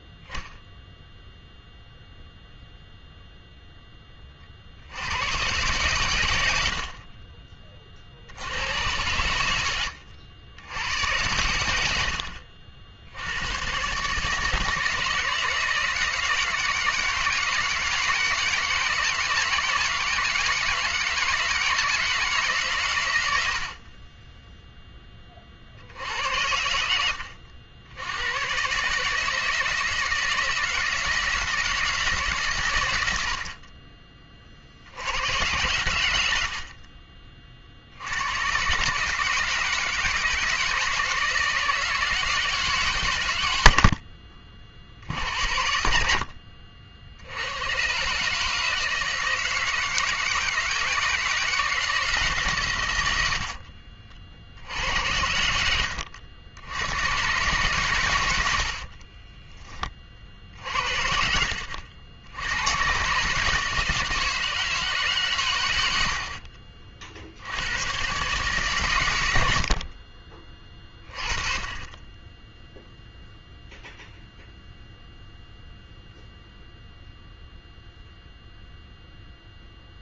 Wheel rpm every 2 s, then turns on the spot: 0, 0, 50, 80, 100, 90, 70, 160, 160, 160, 160, 120, 20, 80, 150, 160, 90, 90, 30, 130, 160, 150, 60, 60, 160, 160, 120, 70, 90, 50, 60, 80, 160, 50, 140, 30, 10, 0, 0, 0.
58-60